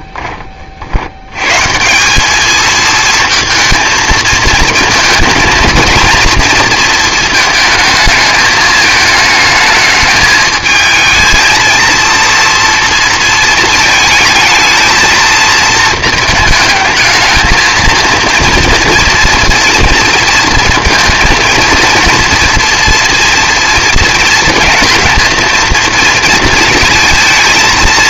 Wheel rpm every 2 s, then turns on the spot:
50, 230, 220, 230, 220, 230, 230, 230, 220, 230, 230, 230, 230, 230.
none